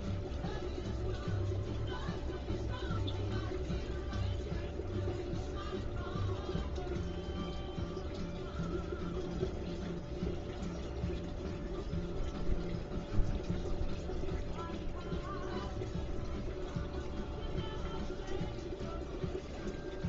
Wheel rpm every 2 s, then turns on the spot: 0, 0, 0, 0, 0, 0, 0, 0, 0, 0.
none